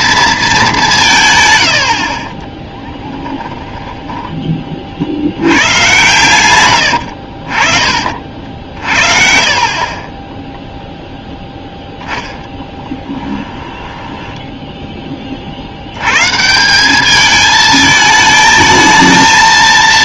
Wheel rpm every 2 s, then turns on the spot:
190, 20, 40, 100, 50, 0, 10, 10, 190, 220.
2-4 8-10 12-14